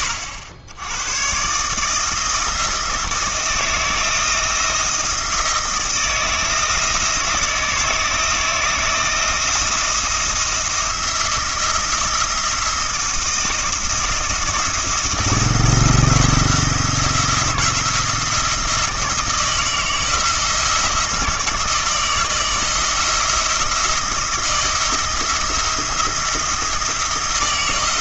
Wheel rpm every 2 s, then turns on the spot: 90, 160, 170, 160, 160, 170, 170, 170, 170, 170, 170, 170, 160, 170.
none